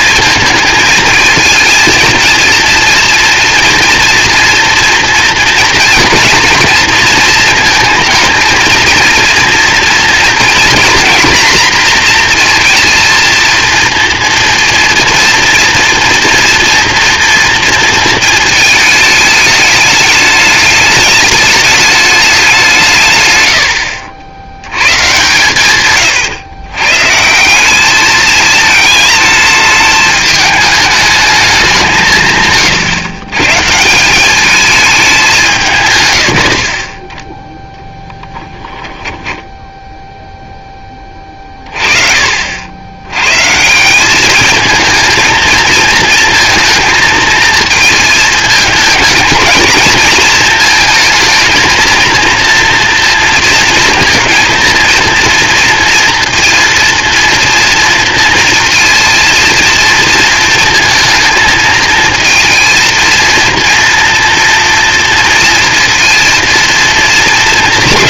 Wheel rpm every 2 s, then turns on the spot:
220, 230, 230, 230, 230, 240, 230, 230, 230, 220, 210, 160, 110, 110, 220, 210, 140, 210, 30, 10, 20, 80, 220, 230, 220, 230, 240, 230, 230, 230, 230, 230, 230, 230.
38-40